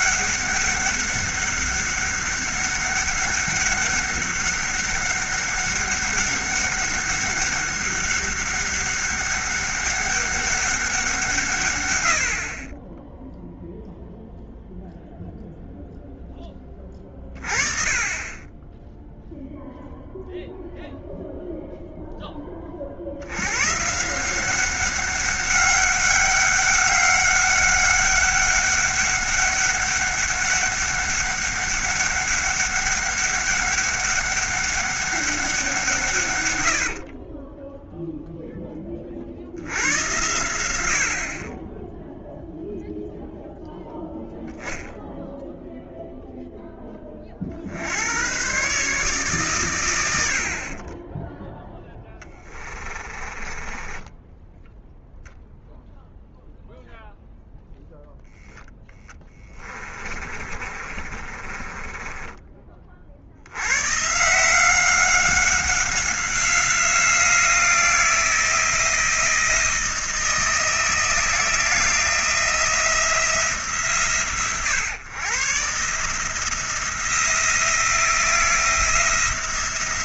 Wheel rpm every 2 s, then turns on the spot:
200, 200, 200, 200, 200, 190, 30, 0, 20, 10, 0, 30, 190, 200, 200, 200, 200, 200, 80, 10, 80, 0, 0, 10, 140, 40, 30, 0, 0, 10, 30, 30, 180, 180, 160, 170, 170, 120, 170, 170.
36-38 50-54 60-62